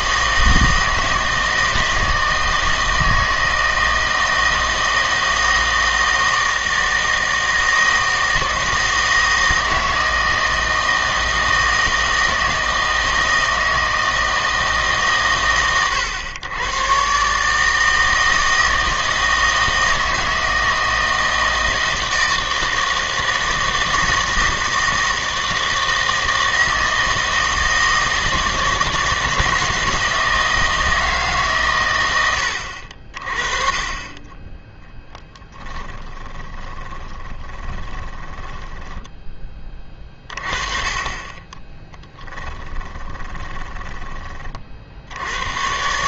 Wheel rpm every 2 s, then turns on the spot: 160, 160, 160, 160, 160, 160, 160, 150, 110, 160, 160, 160, 160, 160, 160, 160, 80, 10, 20, 10, 30, 20, 40.
36-40 42-44